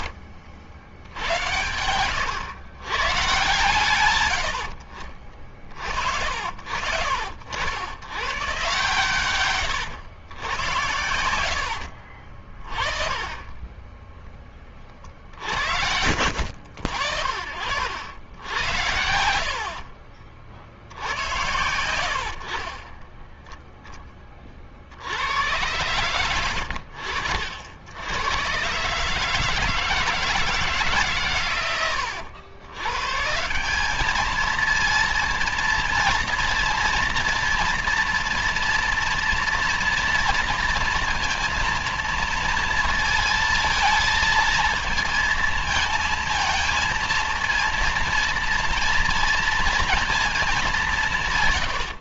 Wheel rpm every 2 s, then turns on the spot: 80, 120, 70, 70, 130, 100, 50, 30, 70, 80, 50, 50, 40, 90, 120, 150, 90, 220, 230, 230, 230, 230, 230, 220, 230, 210.
none